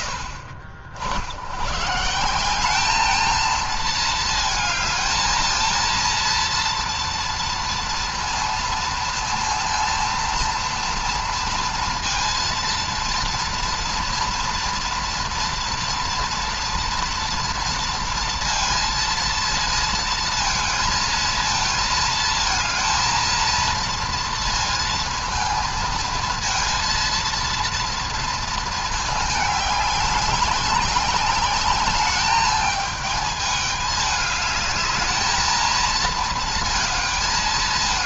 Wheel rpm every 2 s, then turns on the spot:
70, 210, 220, 230, 230, 230, 230, 240, 230, 230, 230, 230, 230, 230, 220, 190, 210, 210, 220.
none